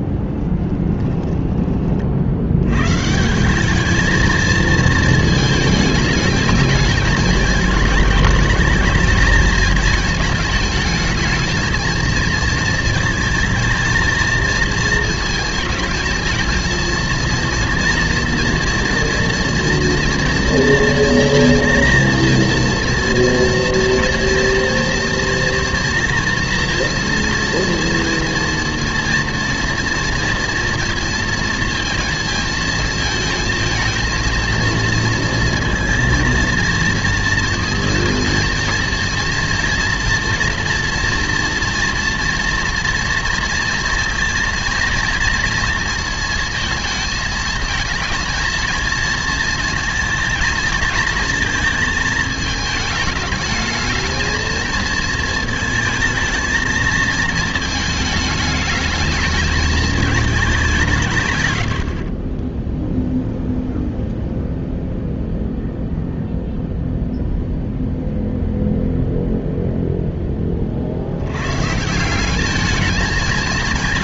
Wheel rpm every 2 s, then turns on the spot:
10, 80, 220, 220, 220, 220, 230, 220, 220, 230, 230, 230, 230, 240, 230, 230, 220, 230, 230, 230, 240, 230, 230, 230, 220, 230, 220, 220, 220, 210, 190, 10, 0, 0, 0, 30, 200.
0-2